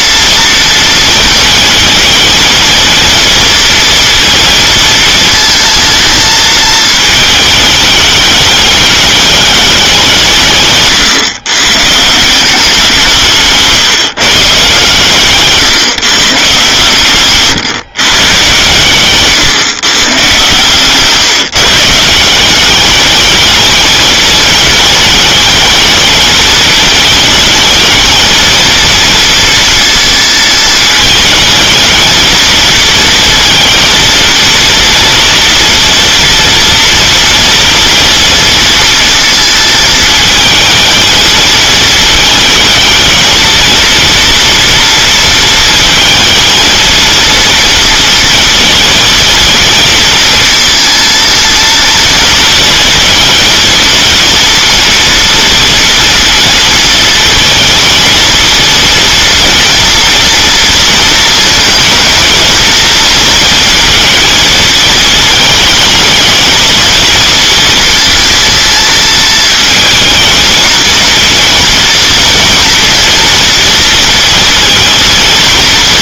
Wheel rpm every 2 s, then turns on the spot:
230, 220, 230, 220, 210, 140, 170, 150, 140, 130, 140, 210, 210, 220, 230, 220, 230, 240, 230, 230, 220, 220, 230, 230, 230, 230, 220, 240, 230, 230, 230, 230, 220, 230, 230, 230, 230, 230.
none